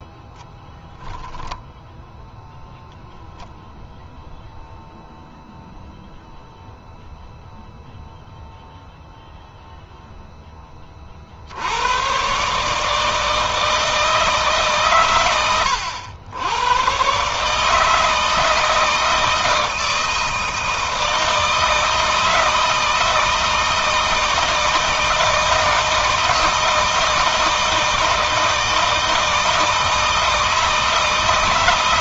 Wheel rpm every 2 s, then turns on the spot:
0, 0, 0, 0, 0, 20, 150, 140, 110, 160, 160, 160, 160, 160, 160, 160.
none